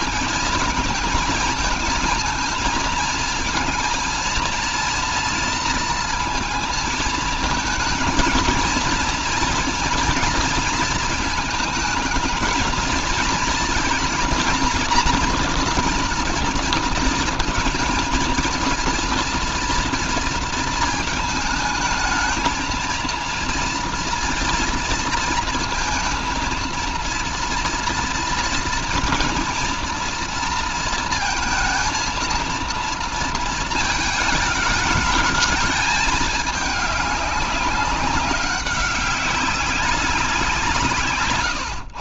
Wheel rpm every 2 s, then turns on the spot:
220, 220, 230, 220, 230, 220, 220, 240, 230, 230, 230, 220, 230, 230, 230, 230, 230, 210, 210, 190, 170.
none